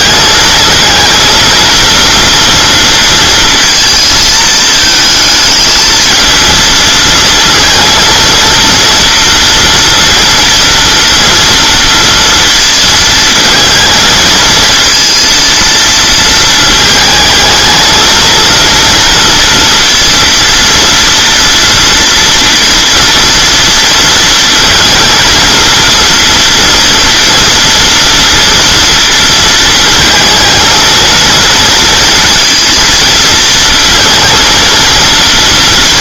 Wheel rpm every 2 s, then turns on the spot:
220, 230, 220, 230, 230, 230, 230, 220, 220, 230, 230, 230, 230, 230, 230, 220, 230, 230.
none